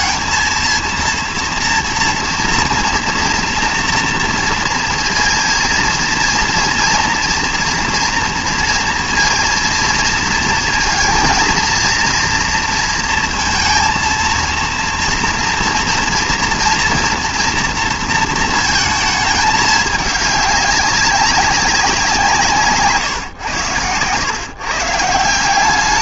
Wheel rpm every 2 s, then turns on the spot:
230, 230, 230, 230, 230, 230, 230, 230, 230, 230, 200, 140, 150.
none